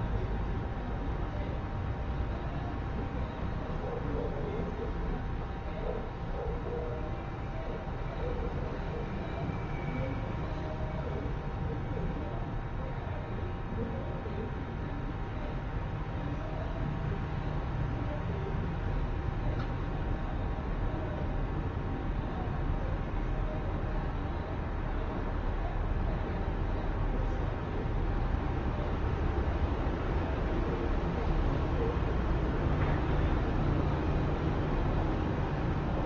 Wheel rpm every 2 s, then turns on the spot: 0, 0, 0, 0, 0, 0, 0, 0, 0, 0, 0, 0, 0, 0, 0, 0, 0, 0.
none